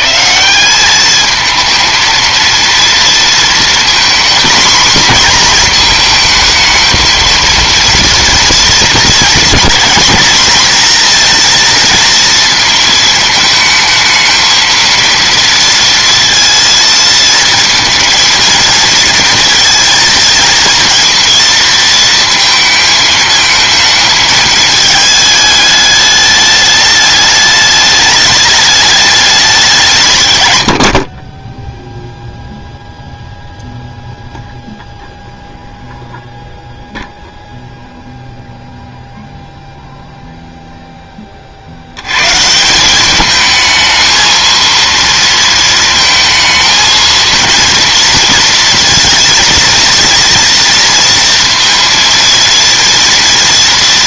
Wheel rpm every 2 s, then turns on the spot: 180, 230, 240, 230, 230, 230, 220, 220, 230, 230, 230, 230, 220, 210, 210, 110, 0, 0, 0, 0, 30, 210, 230, 230, 230, 230, 230.
none